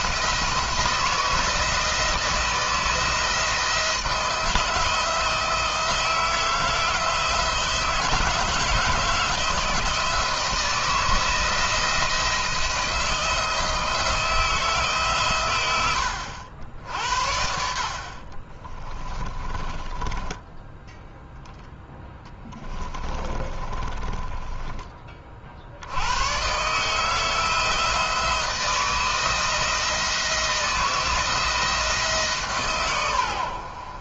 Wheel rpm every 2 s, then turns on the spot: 170, 160, 170, 160, 170, 170, 170, 150, 80, 30, 10, 20, 20, 140, 160, 170, 130.
18-20 22-24